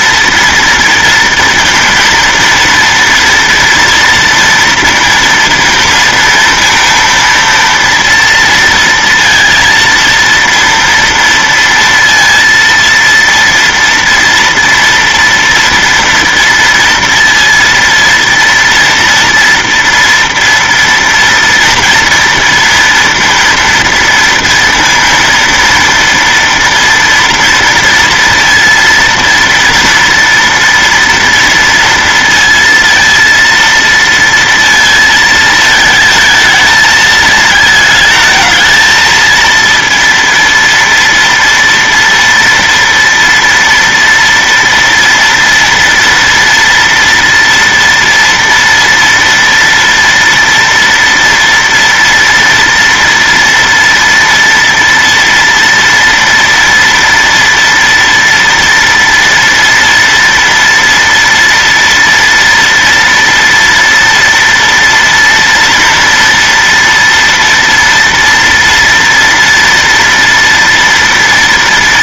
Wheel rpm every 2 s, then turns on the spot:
230, 230, 230, 230, 230, 230, 230, 230, 230, 230, 230, 230, 230, 230, 230, 230, 230, 230, 220, 220, 230, 230, 230, 230, 240, 230, 230, 230, 230, 230, 230, 230, 230, 230, 230, 240.
none